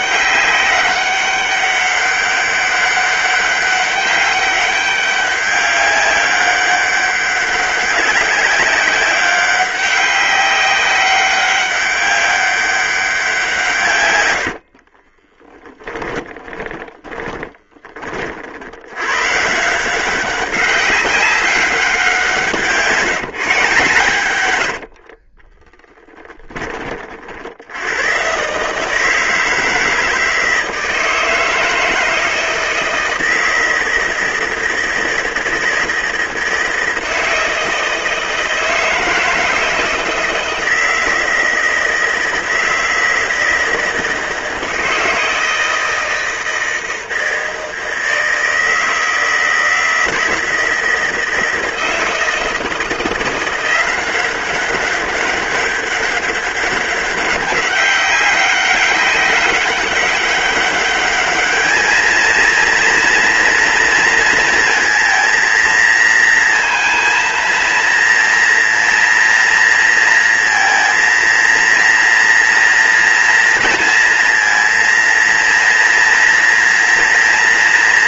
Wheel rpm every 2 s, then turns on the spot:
190, 200, 190, 200, 200, 190, 190, 40, 20, 100, 190, 160, 60, 40, 150, 160, 160, 160, 160, 160, 160, 160, 160, 160, 160, 160, 170, 190, 200, 200, 200, 230, 230, 230, 230, 230, 230, 230, 230.
14-18 24-26